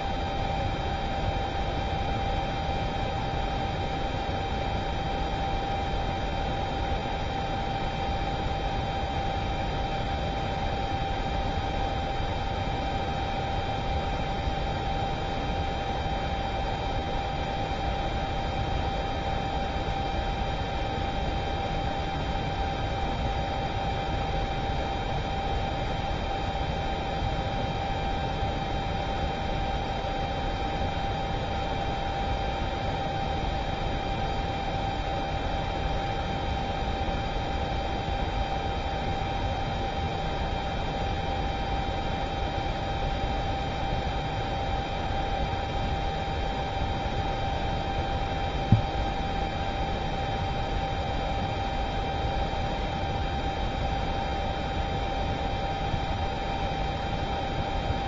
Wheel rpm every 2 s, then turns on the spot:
0, 0, 0, 0, 0, 0, 0, 0, 0, 0, 0, 0, 0, 0, 0, 0, 0, 0, 0, 0, 0, 0, 0, 0, 0, 0, 0, 0, 0.
none